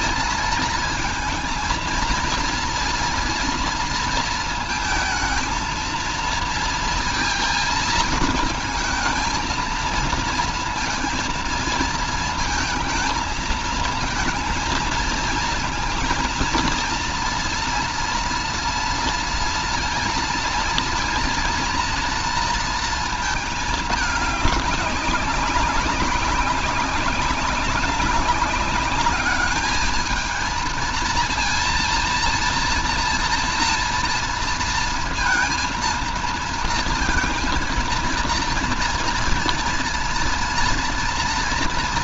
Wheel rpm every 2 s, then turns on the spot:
220, 230, 230, 230, 220, 230, 230, 230, 230, 230, 230, 230, 200, 200, 200, 220, 230, 230, 230, 230, 240.
none